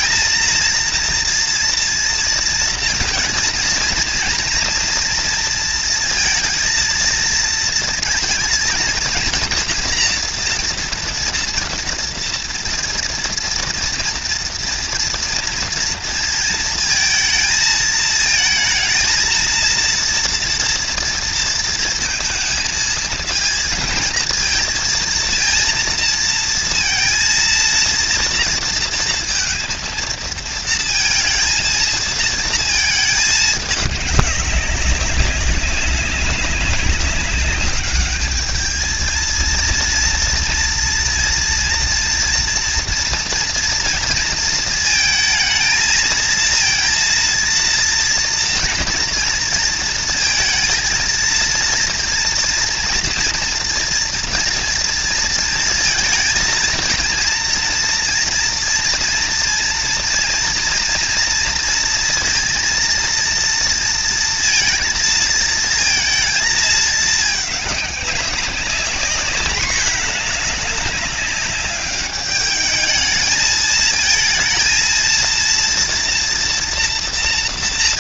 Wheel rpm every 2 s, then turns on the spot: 230, 230, 230, 230, 230, 230, 230, 230, 230, 230, 230, 220, 230, 230, 230, 230, 220, 190, 200, 220, 230, 230, 230, 230, 240, 230, 230, 230, 230, 230, 240, 230, 230, 220, 200, 210, 210, 230, 230.
none